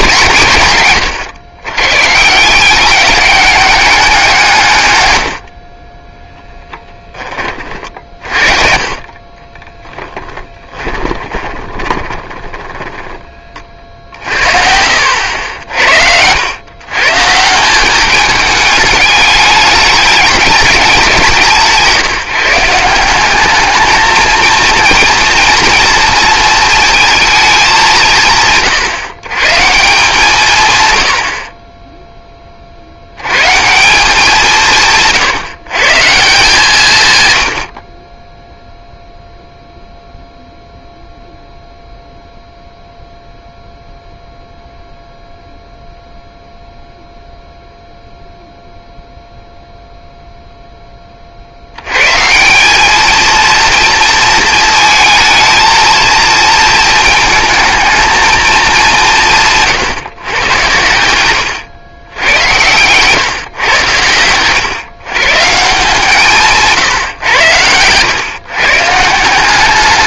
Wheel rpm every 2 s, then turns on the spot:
120, 200, 120, 10, 40, 20, 20, 60, 120, 210, 200, 180, 240, 230, 150, 110, 60, 160, 140, 0, 0, 0, 0, 0, 0, 10, 200, 220, 220, 190, 100, 120, 130, 140, 150.
8-16 62-64